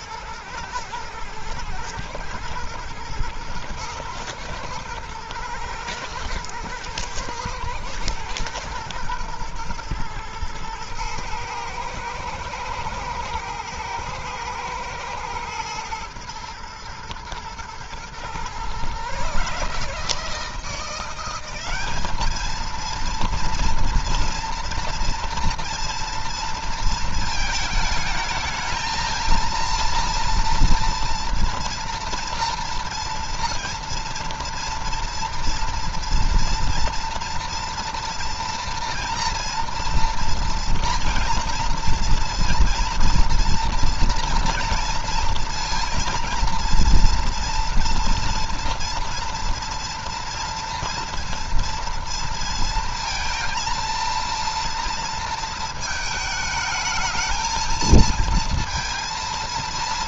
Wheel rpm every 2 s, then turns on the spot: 110, 120, 120, 110, 120, 110, 120, 110, 110, 130, 170, 220, 230, 230, 220, 230, 230, 230, 230, 230, 230, 230, 230, 230, 230, 230, 230, 230, 220, 230.
none